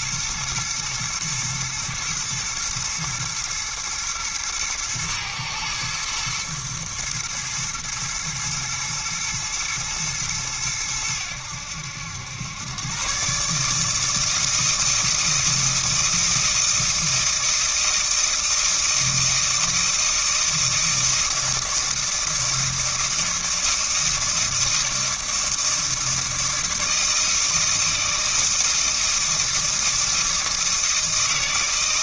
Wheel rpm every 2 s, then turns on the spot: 110, 110, 120, 120, 110, 100, 130, 160, 160, 160, 160, 160, 160, 160, 160, 160.
none